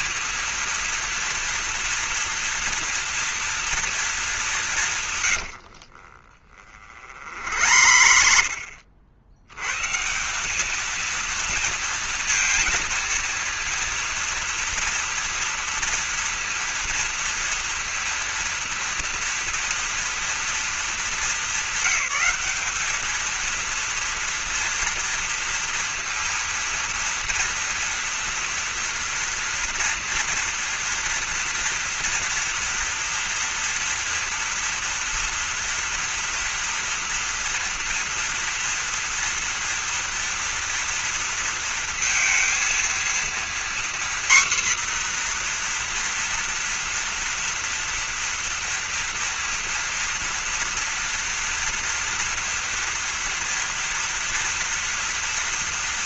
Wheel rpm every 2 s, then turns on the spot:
230, 230, 200, 50, 70, 200, 230, 230, 230, 230, 230, 210, 230, 230, 230, 230, 230, 230, 240, 230, 230, 230, 250, 230, 230, 230, 230, 230.
6-10